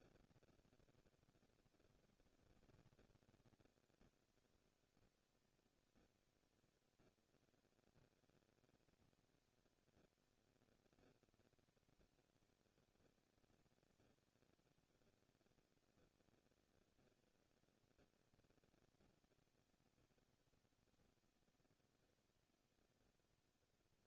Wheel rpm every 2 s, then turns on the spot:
0, 0, 0, 0, 0, 0, 0, 0, 0, 0, 0, 0.
none